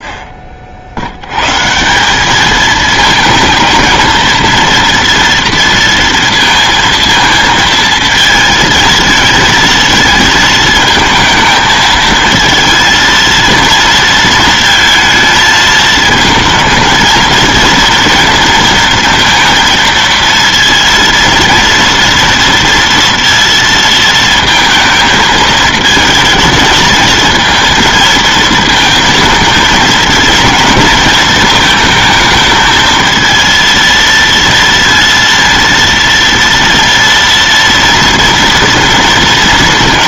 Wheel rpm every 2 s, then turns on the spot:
60, 220, 230, 230, 220, 220, 230, 230, 230, 230, 230, 230, 230, 220, 230, 230, 220, 230, 230, 230.
none